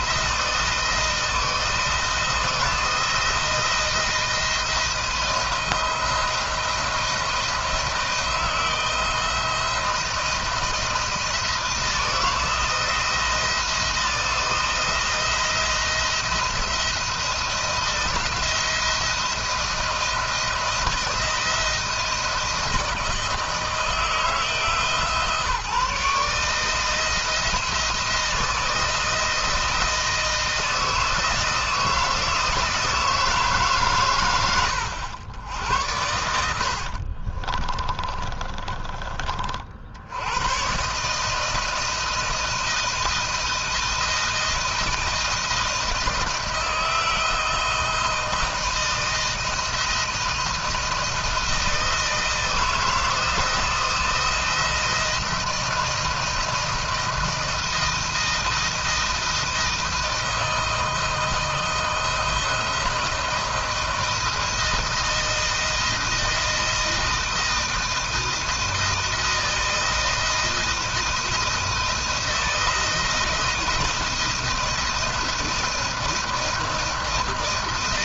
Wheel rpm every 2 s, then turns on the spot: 170, 170, 160, 170, 170, 170, 170, 170, 170, 170, 170, 170, 160, 160, 160, 160, 160, 90, 60, 30, 130, 160, 170, 170, 170, 170, 160, 170, 160, 160, 160, 170, 170, 160, 160, 160, 160, 160, 170.
36-38